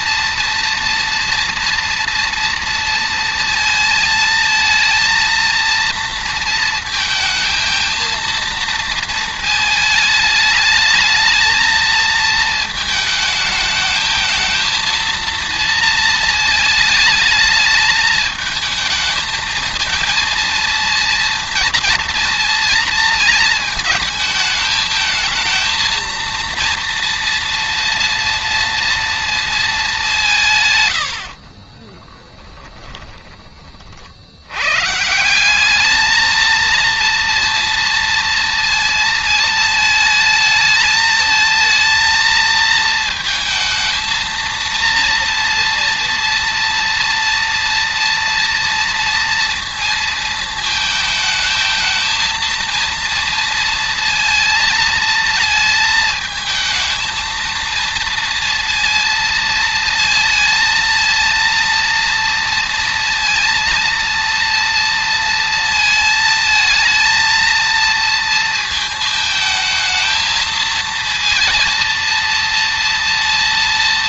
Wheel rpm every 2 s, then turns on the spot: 240, 230, 230, 220, 220, 220, 220, 230, 220, 220, 230, 230, 220, 230, 230, 70, 20, 190, 230, 220, 230, 220, 230, 230, 230, 220, 230, 220, 230, 230, 230, 230, 230, 230, 220, 230, 230.
30-32